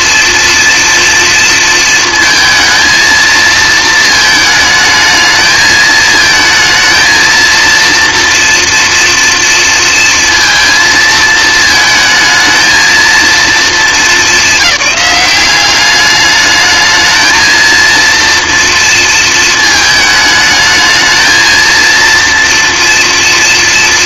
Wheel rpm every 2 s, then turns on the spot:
230, 230, 220, 230, 230, 230, 230, 210, 220, 230, 220, 230.
none